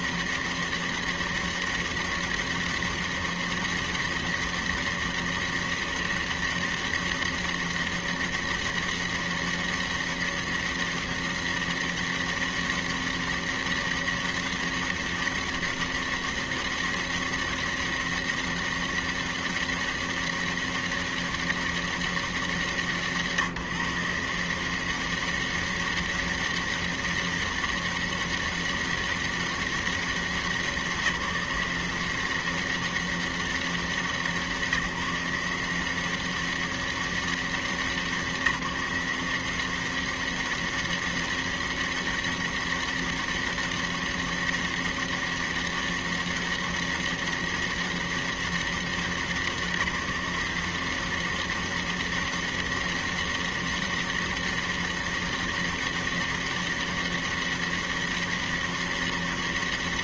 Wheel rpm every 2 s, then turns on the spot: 200, 200, 200, 200, 200, 200, 200, 200, 200, 200, 200, 170, 180, 200, 200, 180, 190, 170, 190, 180, 190, 200, 200, 200, 200, 180, 200, 200, 200, 200.
none